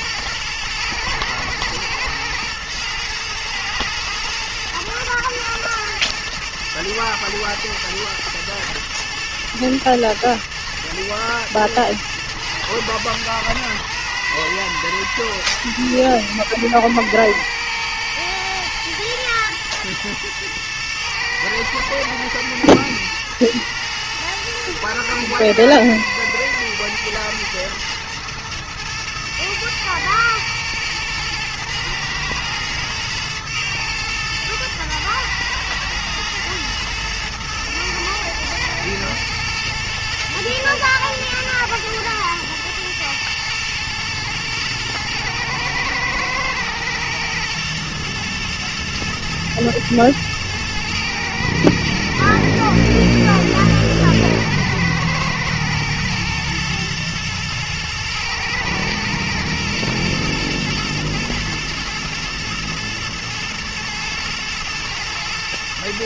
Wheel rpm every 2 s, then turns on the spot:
110, 110, 110, 110, 110, 110, 110, 110, 110, 120, 120, 110, 120, 110, 110, 110, 110, 110, 110, 110, 110, 110, 110, 120, 110, 110, 120, 110, 110, 110, 120, 120, 120.
none